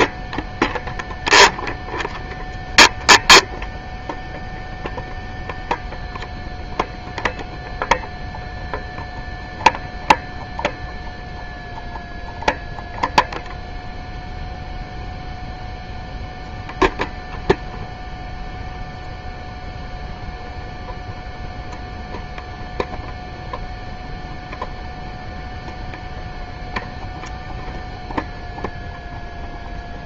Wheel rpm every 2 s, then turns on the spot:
0, 0, 0, 0, 0, 0, 0, 0, 0, 0, 0, 0, 0, 0, 0.
none